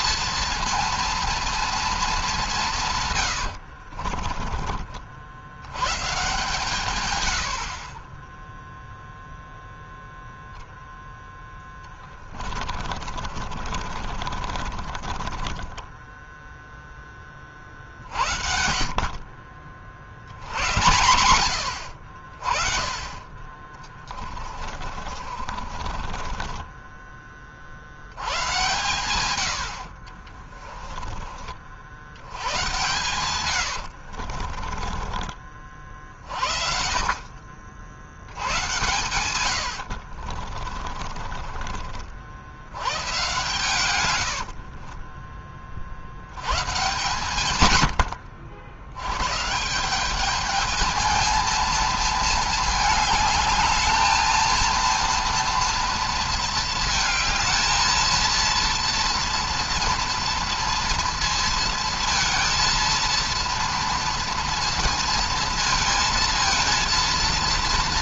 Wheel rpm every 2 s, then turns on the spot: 230, 190, 40, 140, 10, 0, 20, 40, 0, 50, 80, 30, 30, 30, 120, 40, 100, 40, 50, 80, 40, 70, 60, 100, 60, 210, 220, 220, 230, 230, 230, 230, 230, 230.
4-6 12-16 24-28 30-36 40-42 44-46